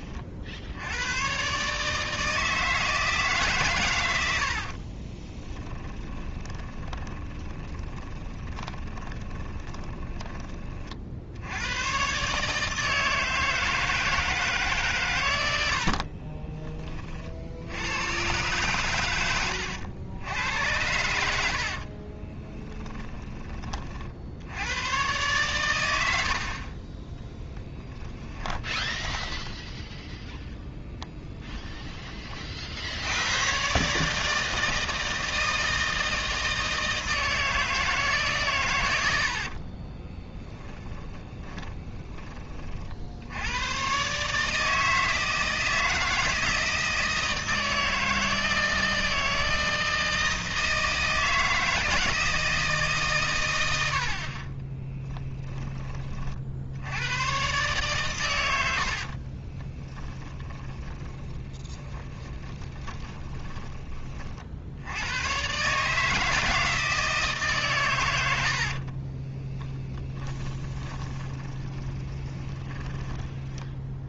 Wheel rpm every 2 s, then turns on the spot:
80, 160, 40, 20, 20, 30, 160, 130, 30, 110, 80, 10, 110, 30, 10, 0, 60, 160, 160, 100, 20, 50, 160, 160, 160, 160, 150, 20, 90, 80, 20, 20, 80, 160, 60, 20, 20.
4-10 22-24 28-30 38-42 54-56 58-64 68-74